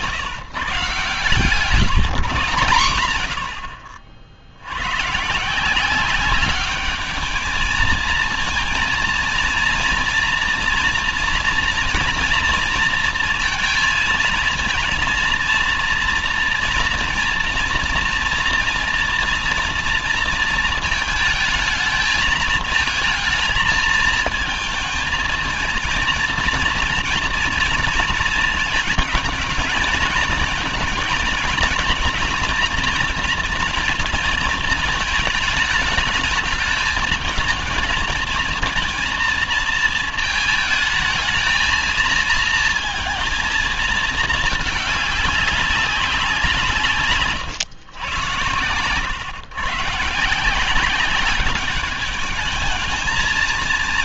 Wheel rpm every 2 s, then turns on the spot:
120, 120, 80, 200, 230, 240, 230, 220, 230, 230, 230, 220, 220, 230, 220, 230, 230, 220, 220, 230, 220, 220, 220, 180, 120, 170, 210.
none